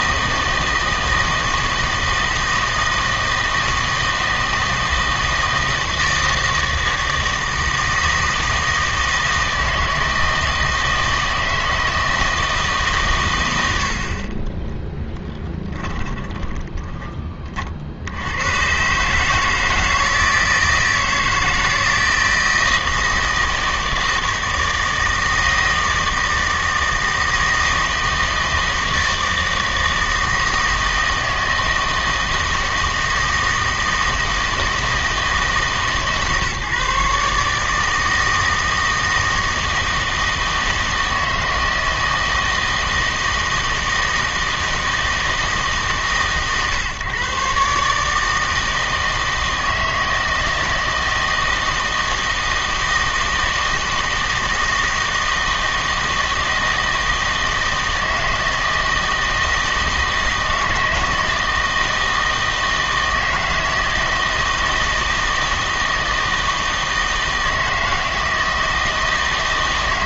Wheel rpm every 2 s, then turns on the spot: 160, 160, 160, 160, 160, 160, 140, 10, 20, 130, 160, 160, 160, 160, 160, 160, 160, 160, 150, 160, 160, 160, 160, 140, 160, 160, 160, 160, 160, 160, 160, 160, 160, 160, 160.
14-18